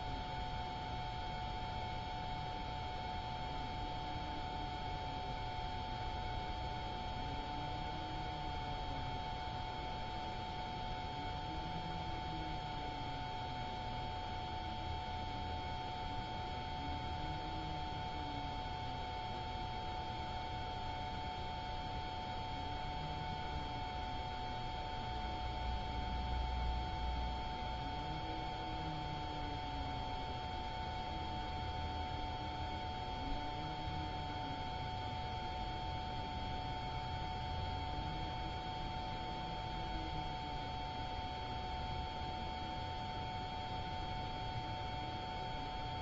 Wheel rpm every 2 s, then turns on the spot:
0, 0, 0, 0, 0, 0, 0, 0, 0, 0, 0, 0, 0, 0, 0, 0, 0, 0, 0, 0, 0, 0, 0.
none